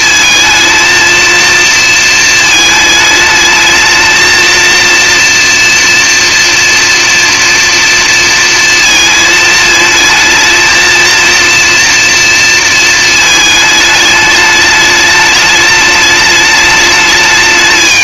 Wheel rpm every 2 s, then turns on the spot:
230, 220, 230, 230, 230, 220, 230, 210, 210.
none